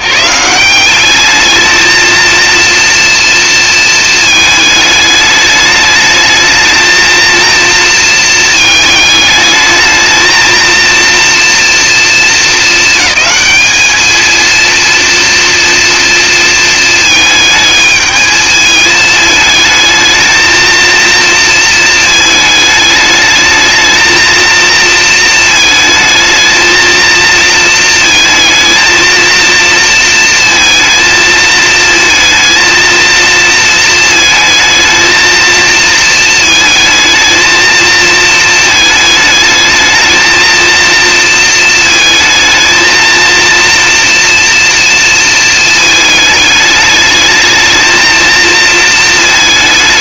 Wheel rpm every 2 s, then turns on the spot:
180, 230, 210, 220, 220, 230, 210, 230, 230, 220, 230, 210, 230, 220, 220, 230, 230, 220, 220, 220, 230, 230, 230, 210, 220.
none